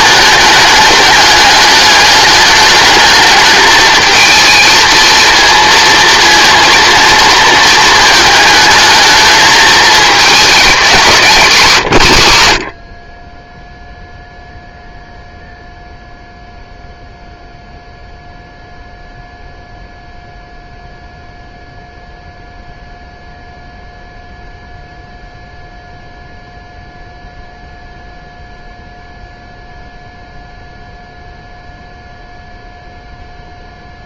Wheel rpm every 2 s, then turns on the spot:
210, 210, 230, 230, 220, 200, 60, 0, 0, 0, 0, 0, 0, 0, 0, 0, 0.
none